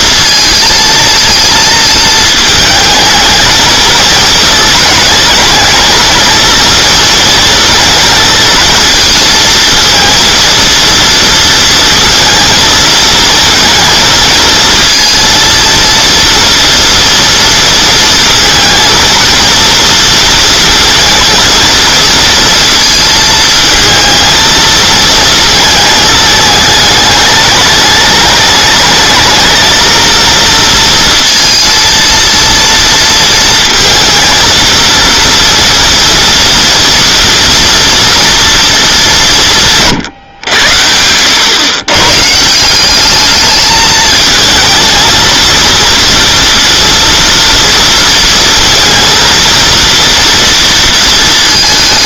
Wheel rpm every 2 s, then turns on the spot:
230, 220, 220, 230, 230, 230, 230, 230, 230, 230, 230, 230, 220, 210, 210, 230, 230, 230, 230, 230, 100, 170, 220, 230, 220, 230.
none